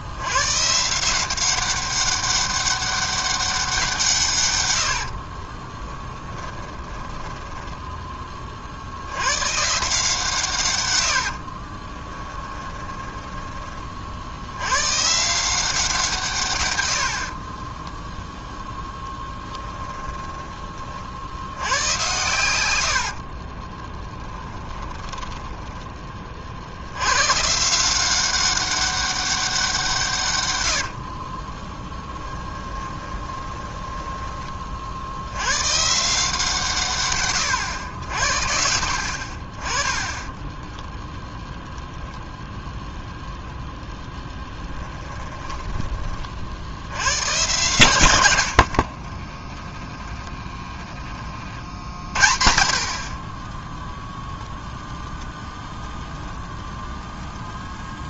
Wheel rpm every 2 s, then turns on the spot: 140, 200, 90, 10, 50, 120, 20, 110, 90, 0, 30, 90, 20, 70, 190, 70, 20, 60, 150, 60, 10, 0, 10, 80, 60, 10, 40, 0, 0.
6-8 12-14 24-26 32-34 40-42 44-46 48-52